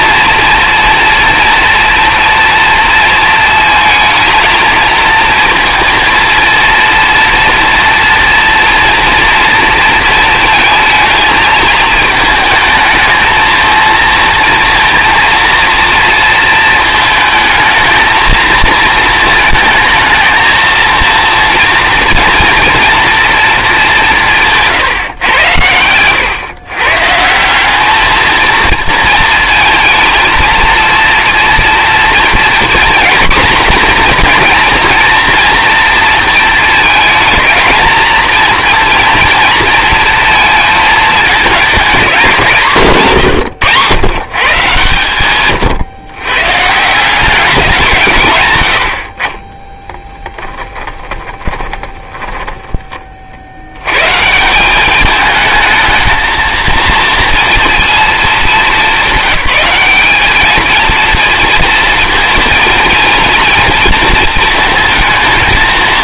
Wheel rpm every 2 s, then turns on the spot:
230, 230, 230, 230, 230, 220, 220, 230, 220, 230, 220, 230, 150, 130, 230, 230, 240, 240, 230, 230, 230, 150, 140, 140, 90, 10, 20, 190, 230, 210, 220, 230, 230.
50-52